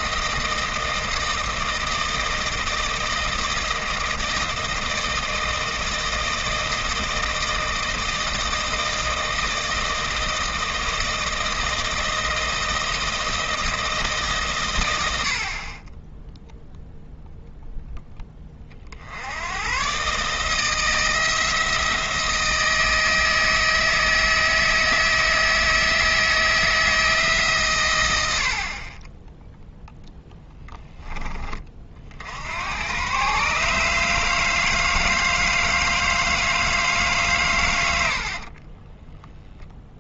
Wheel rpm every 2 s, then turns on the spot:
160, 160, 160, 160, 160, 160, 160, 110, 0, 40, 160, 160, 160, 160, 40, 10, 100, 160, 150, 20.
38-40